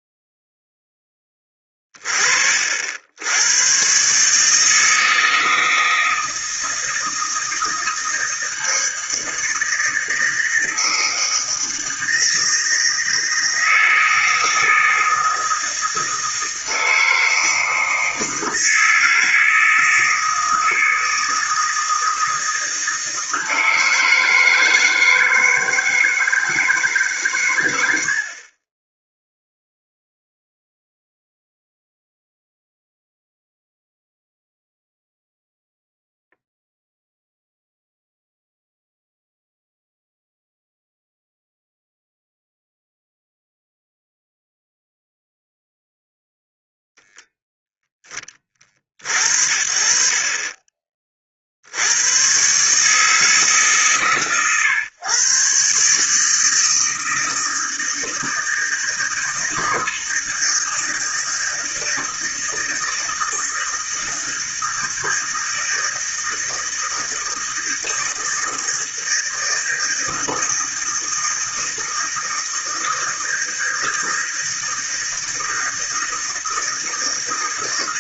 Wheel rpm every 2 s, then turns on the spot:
0, 60, 160, 160, 160, 160, 160, 160, 160, 160, 160, 160, 160, 150, 20, 0, 0, 0, 0, 0, 0, 0, 0, 0, 40, 30, 140, 130, 160, 160, 160, 160, 160, 160, 160, 160, 160, 160, 160.
none